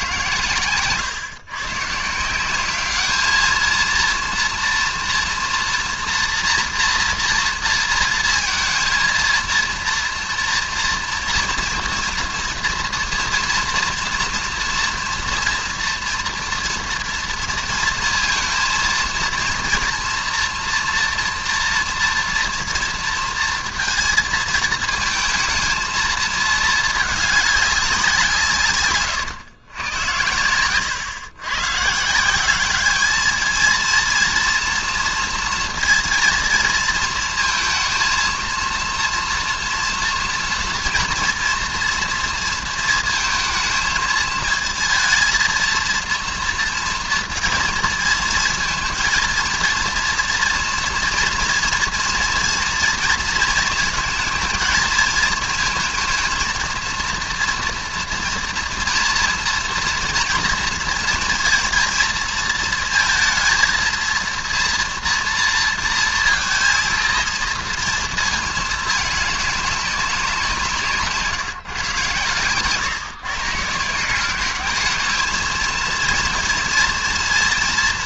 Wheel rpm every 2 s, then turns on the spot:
130, 200, 230, 230, 230, 230, 230, 230, 230, 230, 230, 230, 220, 220, 150, 110, 200, 230, 220, 230, 230, 230, 220, 230, 220, 230, 230, 220, 230, 230, 230, 220, 230, 230, 210, 170, 120, 200, 240.
none